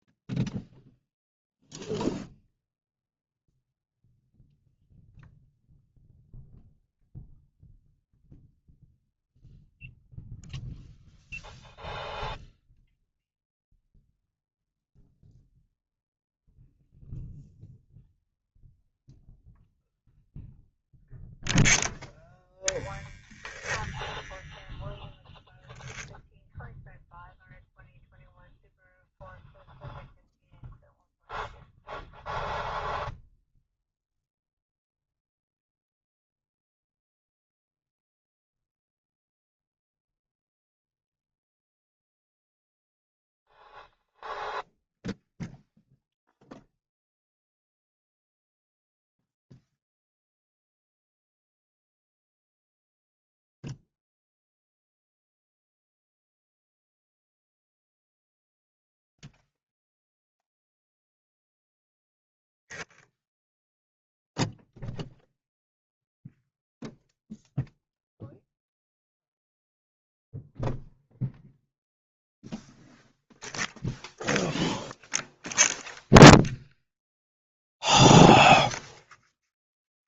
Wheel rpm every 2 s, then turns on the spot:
0, 0, 0, 0, 0, 0, 0, 0, 0, 0, 0, 0, 0, 0, 0, 0, 0, 0, 0, 0, 0, 0, 0, 0, 0, 0, 0, 0, 0, 0, 0, 0, 0, 0, 0, 0, 0, 0, 0, 0.
none